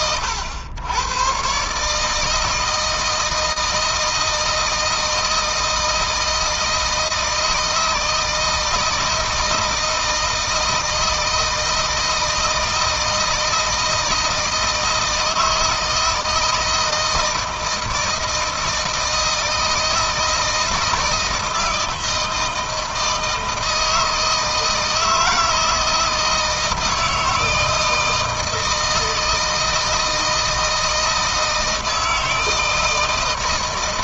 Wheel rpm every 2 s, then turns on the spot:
100, 160, 160, 160, 160, 160, 160, 160, 160, 160, 160, 160, 160, 160, 160, 160, 160.
none